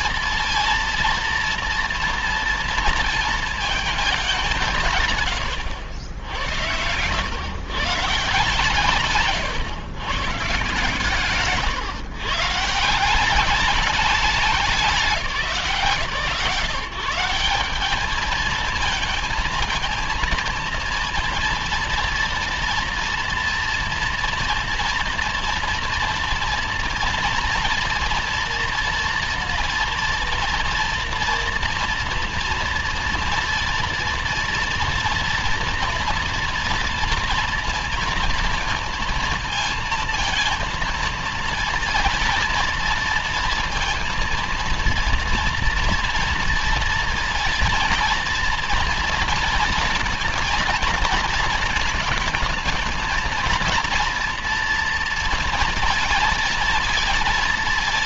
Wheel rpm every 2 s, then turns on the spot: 230, 230, 130, 100, 120, 150, 160, 180, 170, 220, 230, 230, 230, 230, 230, 240, 240, 230, 230, 220, 230, 230, 230, 230, 230, 230, 230, 230, 230.
none